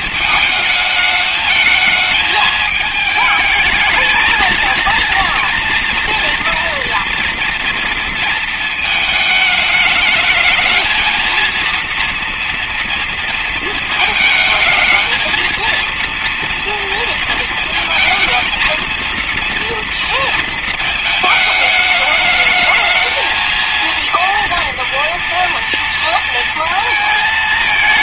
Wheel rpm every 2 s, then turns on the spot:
220, 220, 230, 230, 230, 220, 230, 230, 230, 220, 230, 220, 240, 230.
none